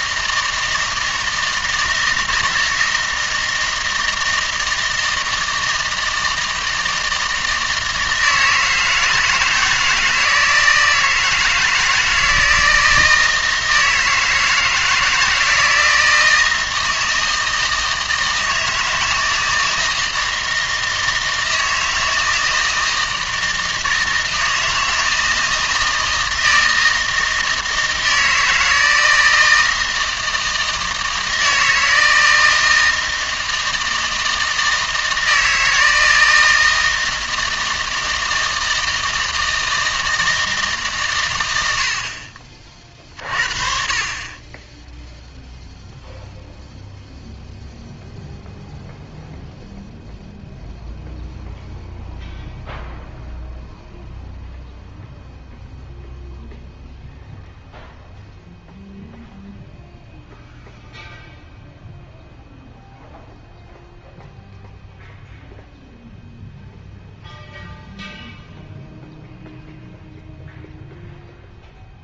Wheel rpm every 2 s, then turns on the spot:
160, 160, 160, 160, 160, 160, 160, 160, 160, 160, 160, 160, 160, 160, 160, 160, 160, 160, 160, 160, 150, 40, 10, 0, 0, 0, 0, 0, 0, 0, 0, 0, 0, 0, 0, 0.
none